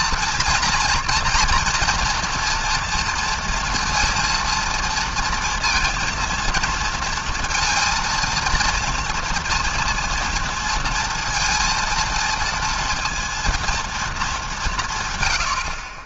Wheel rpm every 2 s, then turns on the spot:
230, 230, 230, 230, 230, 230, 230, 150.
none